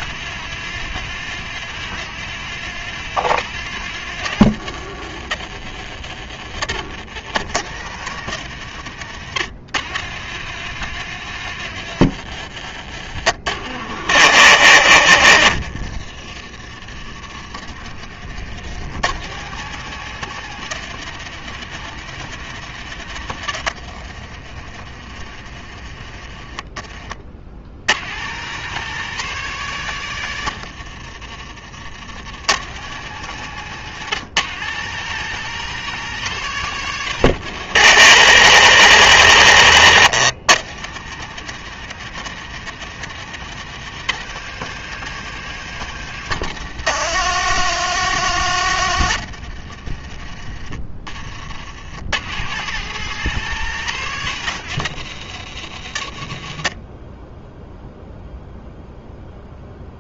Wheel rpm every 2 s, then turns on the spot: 130, 130, 100, 80, 100, 120, 90, 50, 40, 70, 130, 120, 50, 30, 120, 70, 100, 120, 120, 70, 90, 130, 130, 80, 50, 30, 110, 110, 40, 0.
6-8 24-28 30-32 48-50